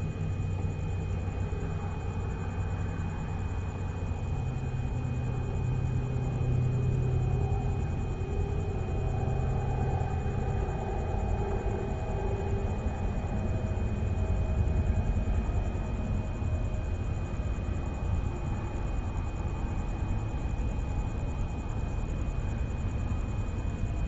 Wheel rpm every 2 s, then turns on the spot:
0, 0, 0, 0, 0, 0, 0, 0, 0, 0, 0, 0.
none